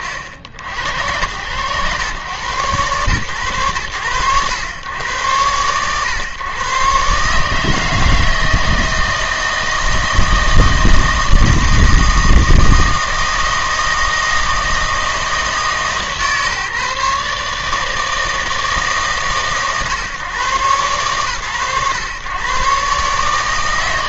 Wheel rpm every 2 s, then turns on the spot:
80, 110, 100, 120, 160, 160, 160, 160, 150, 150, 130, 120.
none